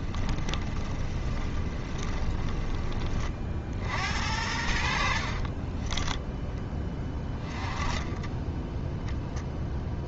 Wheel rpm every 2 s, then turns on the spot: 20, 20, 70, 10, 10.
0-2 8-10